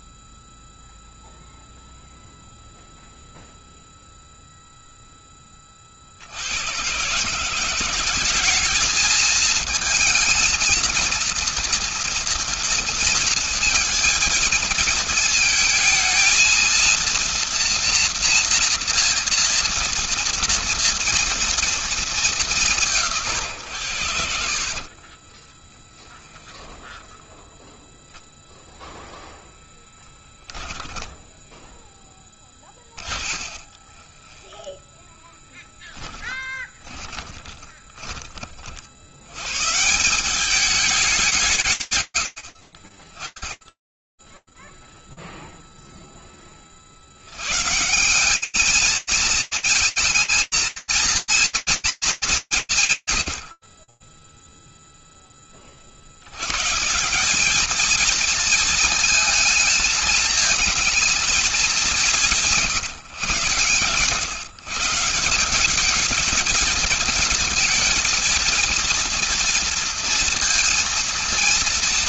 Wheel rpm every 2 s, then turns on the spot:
0, 0, 30, 180, 220, 230, 230, 220, 240, 230, 220, 100, 20, 0, 0, 10, 30, 10, 20, 110, 180, 40, 0, 160, 220, 240, 70, 30, 200, 220, 210, 140, 190, 230, 230, 230.
24-26 30-34 36-38